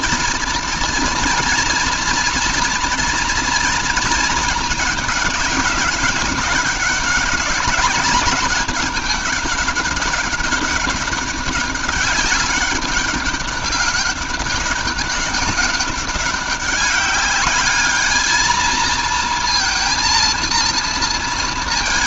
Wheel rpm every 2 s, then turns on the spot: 230, 230, 210, 200, 200, 200, 200, 200, 200, 220, 230.
none